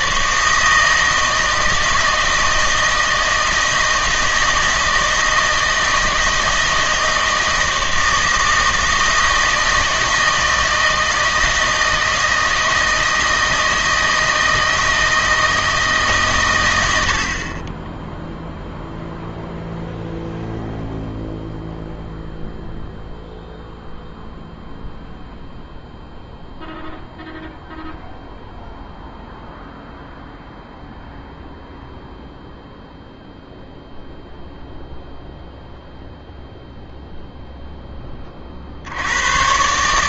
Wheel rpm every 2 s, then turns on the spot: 160, 160, 160, 160, 160, 160, 160, 160, 110, 0, 0, 0, 0, 0, 0, 0, 0, 0, 0, 50.
none